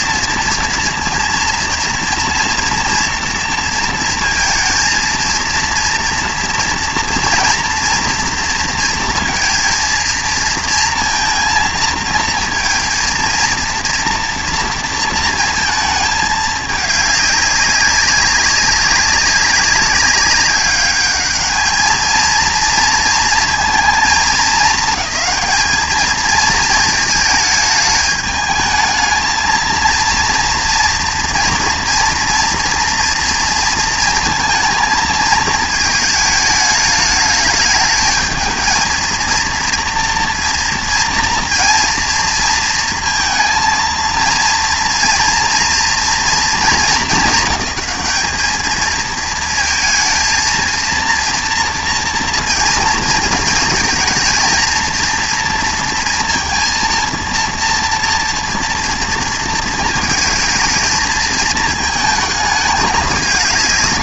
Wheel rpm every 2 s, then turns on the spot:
230, 230, 230, 230, 230, 230, 230, 230, 210, 200, 200, 230, 220, 220, 220, 230, 230, 220, 210, 230, 230, 230, 230, 200, 220, 230, 230, 230, 230, 230, 220, 220.
none